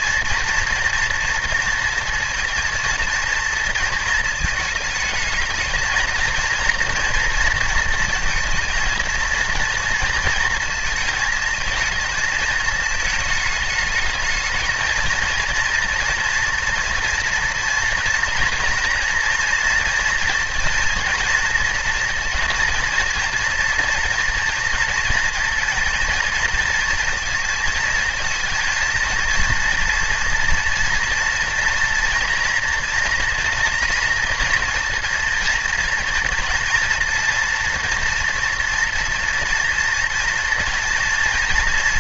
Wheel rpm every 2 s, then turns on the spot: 240, 230, 220, 240, 220, 220, 220, 230, 240, 230, 230, 230, 230, 230, 230, 240, 230, 230, 230, 230, 230.
none